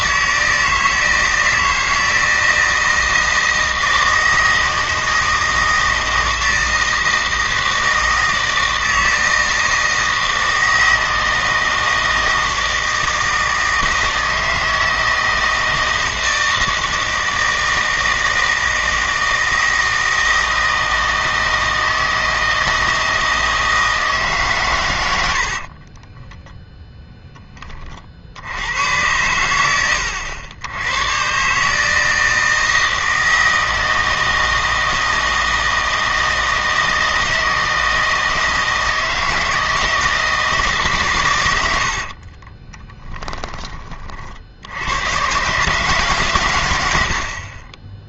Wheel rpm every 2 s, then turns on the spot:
160, 160, 160, 160, 160, 160, 160, 160, 160, 160, 160, 160, 110, 0, 100, 90, 160, 160, 160, 160, 150, 10, 90, 100.
42-44 46-48